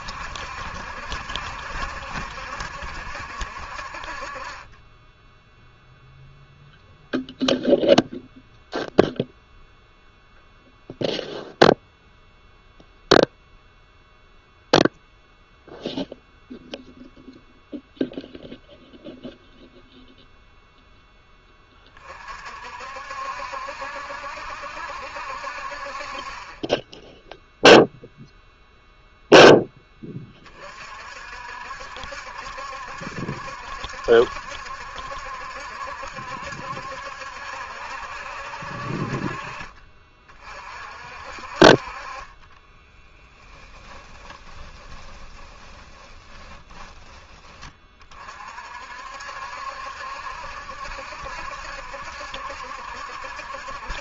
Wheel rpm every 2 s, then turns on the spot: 60, 70, 20, 0, 0, 0, 0, 0, 0, 0, 0, 60, 70, 20, 0, 40, 70, 70, 70, 60, 40, 20, 20, 20, 50, 70, 70.
42-48